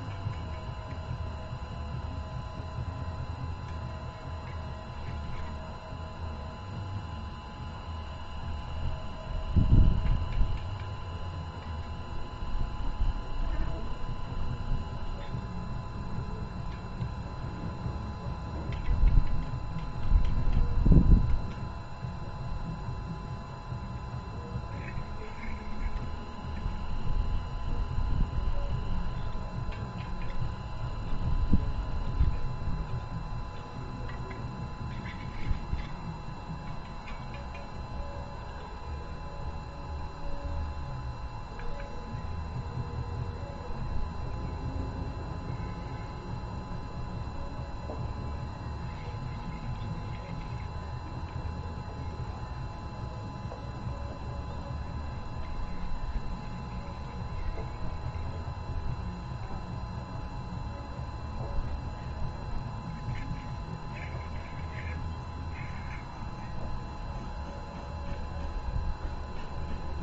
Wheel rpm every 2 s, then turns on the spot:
0, 0, 0, 0, 0, 0, 0, 0, 0, 0, 0, 0, 0, 0, 0, 0, 0, 0, 0, 0, 0, 0, 0, 0, 0, 0, 0, 0, 0, 0, 0, 0, 0, 0, 0.
none